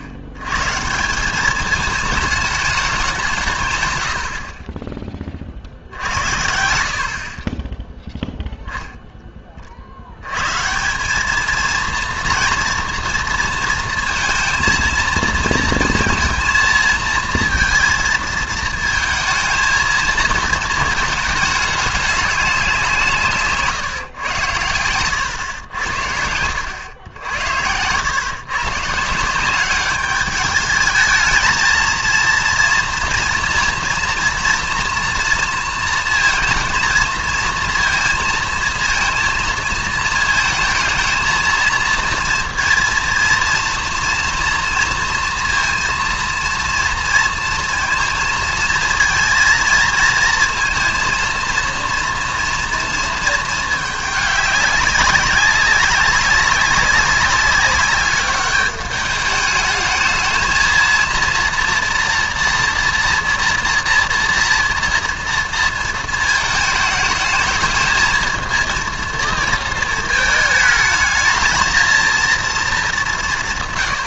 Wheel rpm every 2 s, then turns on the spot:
130, 210, 40, 70, 0, 150, 230, 230, 230, 220, 220, 180, 110, 90, 130, 210, 230, 230, 230, 230, 220, 230, 230, 230, 230, 230, 230, 200, 200, 200, 230, 230, 230, 220, 230, 220, 220.
none